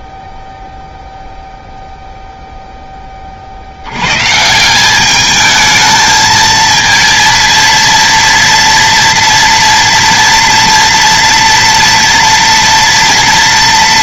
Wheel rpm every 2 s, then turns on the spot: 0, 0, 170, 230, 230, 230, 230.
none